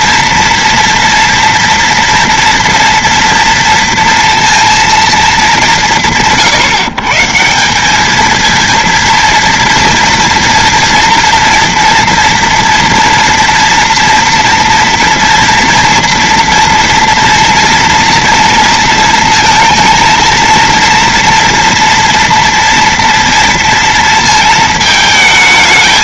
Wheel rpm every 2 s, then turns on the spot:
230, 230, 230, 170, 220, 230, 230, 230, 230, 230, 230, 240, 220.
none